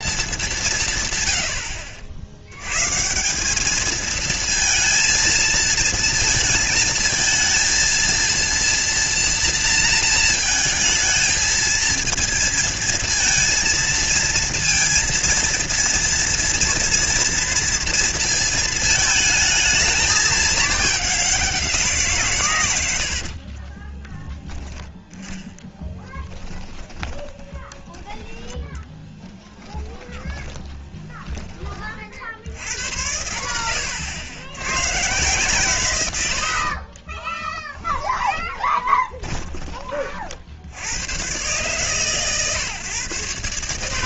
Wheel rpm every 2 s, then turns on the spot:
160, 120, 230, 220, 230, 230, 230, 230, 230, 220, 210, 100, 10, 10, 20, 10, 90, 110, 50, 10, 80, 130.
22-24 26-28 30-32 36-40